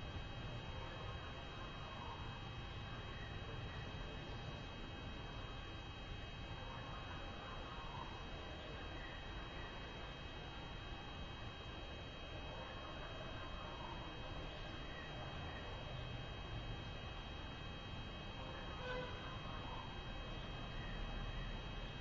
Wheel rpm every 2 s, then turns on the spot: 0, 0, 0, 0, 0, 0, 0, 0, 0, 0, 0.
none